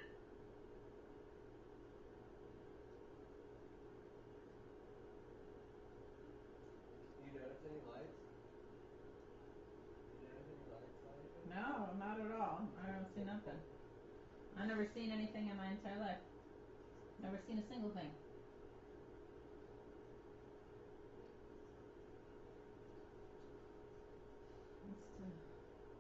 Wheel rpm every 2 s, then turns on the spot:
0, 0, 0, 0, 0, 0, 0, 0, 0, 0, 0, 0, 0.
none